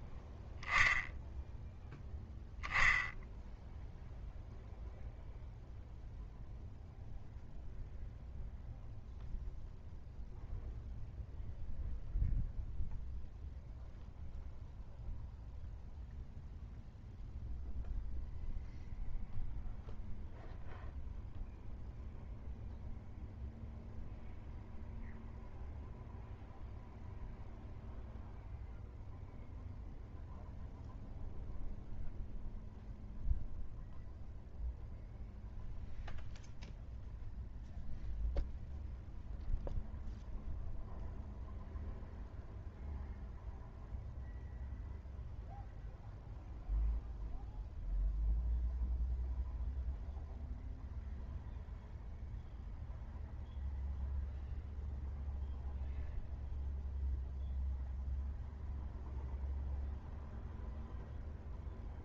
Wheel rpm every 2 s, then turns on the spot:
0, 0, 0, 0, 0, 0, 0, 0, 0, 0, 0, 0, 0, 0, 0, 0, 0, 0, 0, 0, 0, 0, 0, 0, 0, 0, 0, 0, 0, 0, 0.
none